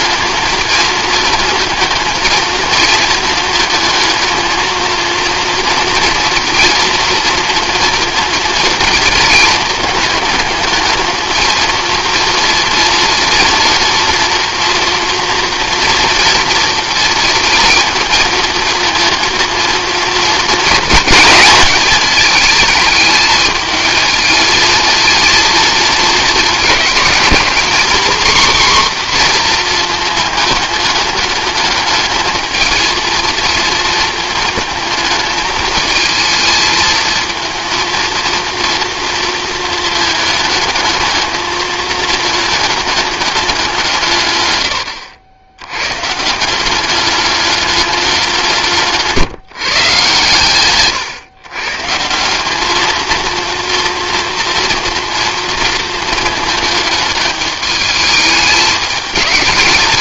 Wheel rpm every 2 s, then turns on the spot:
220, 220, 230, 230, 220, 220, 230, 230, 230, 230, 230, 220, 220, 220, 260, 210, 220, 220, 220, 230, 220, 210, 100, 190, 170, 130, 210, 240, 220, 210.
none